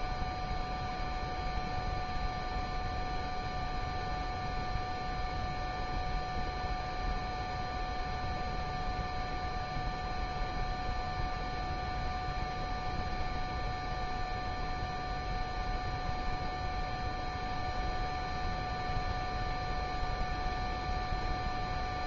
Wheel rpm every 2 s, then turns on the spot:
0, 0, 0, 0, 0, 0, 0, 0, 0, 0, 0.
none